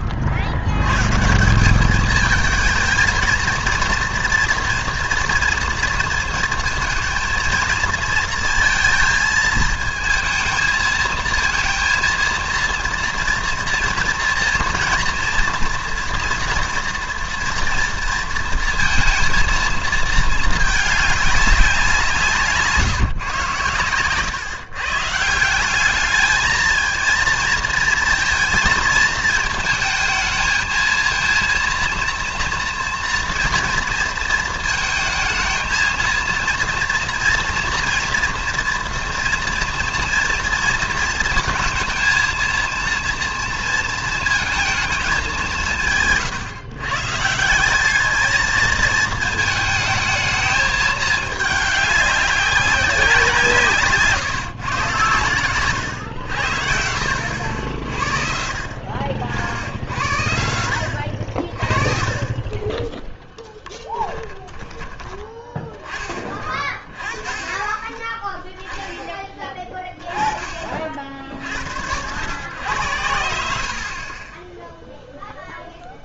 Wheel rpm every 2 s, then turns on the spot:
90, 220, 230, 230, 230, 220, 230, 230, 230, 230, 220, 170, 140, 220, 230, 220, 230, 230, 230, 240, 230, 230, 230, 150, 220, 220, 190, 130, 80, 50, 70, 20, 20, 30, 0, 30, 100, 10.
none